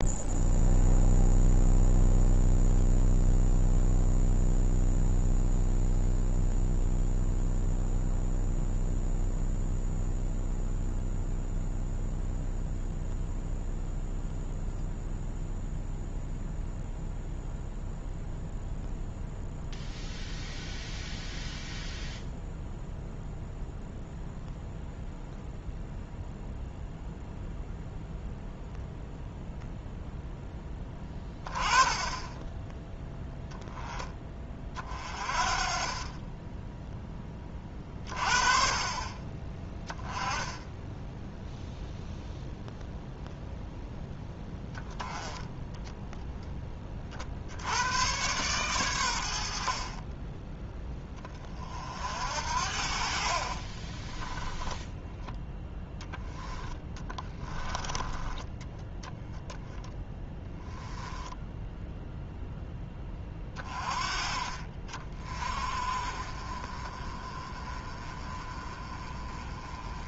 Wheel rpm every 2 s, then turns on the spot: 0, 0, 0, 0, 0, 0, 0, 0, 0, 0, 0, 0, 0, 0, 0, 10, 10, 30, 10, 30, 10, 0, 20, 20, 110, 10, 60, 10, 20, 10, 10, 10, 40, 30, 30.
56-58